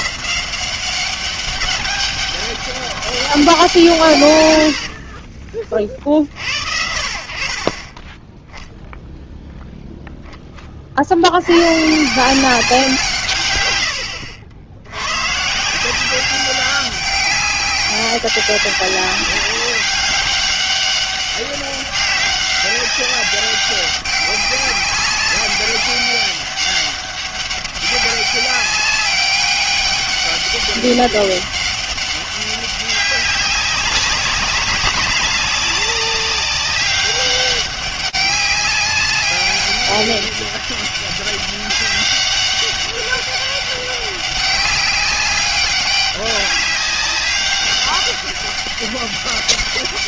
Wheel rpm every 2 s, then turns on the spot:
200, 160, 30, 30, 0, 70, 140, 110, 200, 190, 200, 190, 200, 200, 200, 200, 200, 200, 200, 200, 200, 200, 200, 200, 200.
none